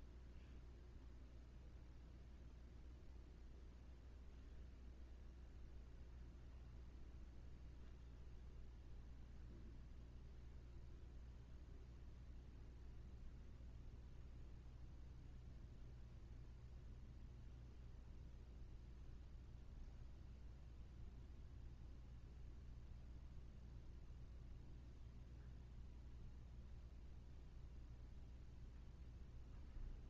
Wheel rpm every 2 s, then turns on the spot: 0, 0, 0, 0, 0, 0, 0, 0, 0, 0, 0, 0, 0, 0, 0.
none